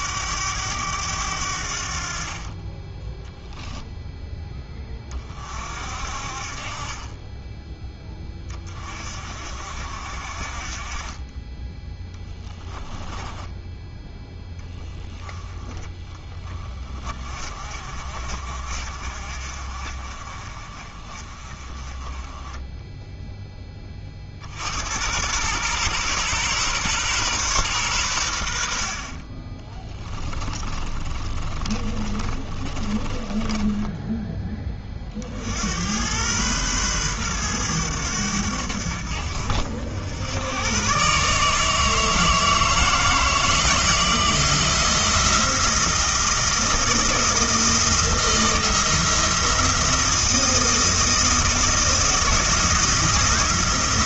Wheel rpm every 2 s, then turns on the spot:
100, 20, 20, 40, 30, 30, 10, 10, 30, 50, 40, 10, 90, 130, 60, 30, 30, 30, 120, 80, 120, 160, 170, 170, 170, 170, 170.
12-14 30-34